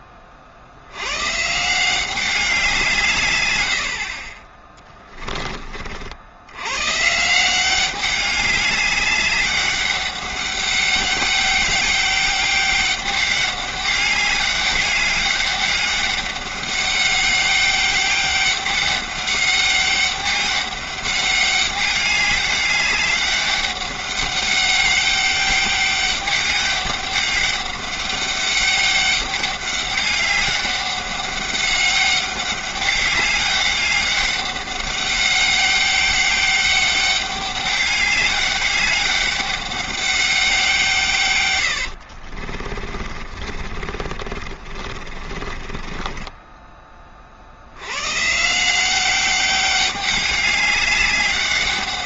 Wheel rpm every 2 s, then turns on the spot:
60, 170, 20, 110, 200, 200, 200, 200, 200, 200, 200, 200, 200, 200, 200, 200, 200, 200, 200, 200, 170, 30, 40, 20, 170, 200.
4-6 42-48